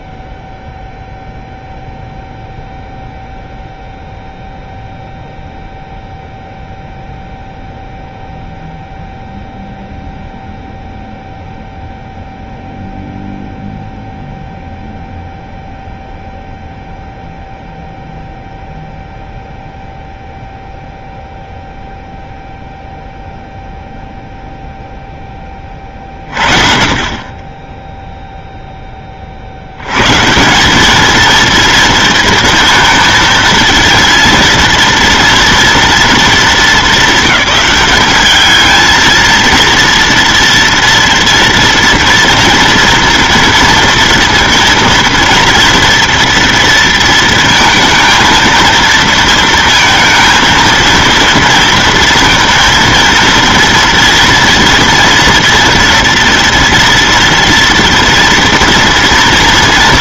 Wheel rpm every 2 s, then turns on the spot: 0, 0, 0, 0, 0, 0, 0, 0, 0, 0, 0, 0, 0, 40, 0, 180, 230, 230, 210, 210, 230, 240, 230, 230, 230, 230, 230, 230, 240, 230.
none